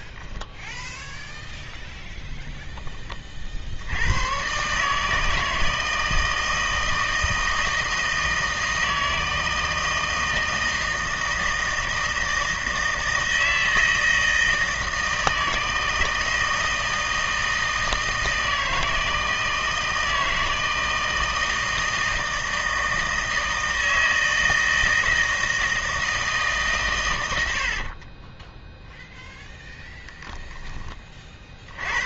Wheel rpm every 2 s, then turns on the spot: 0, 10, 140, 160, 160, 160, 160, 160, 160, 160, 160, 160, 160, 140, 0, 10.
none